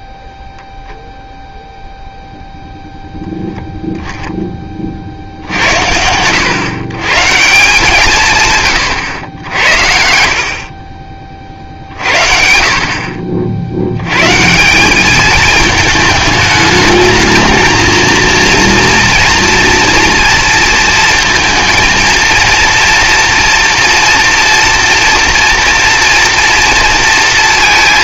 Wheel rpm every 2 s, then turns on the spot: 0, 0, 40, 110, 130, 40, 60, 190, 210, 230, 230, 230, 230, 230.
none